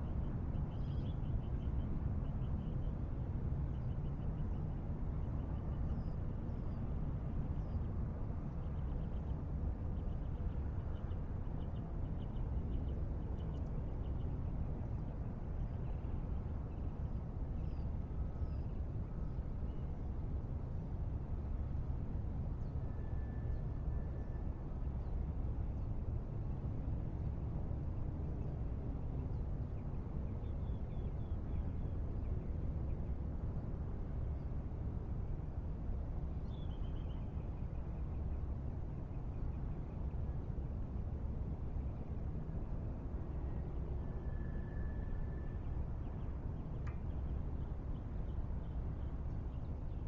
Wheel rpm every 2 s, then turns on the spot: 0, 0, 0, 0, 0, 0, 0, 0, 0, 0, 0, 0, 0, 0, 0, 0, 0, 0, 0, 0, 0, 0, 0, 0, 0.
none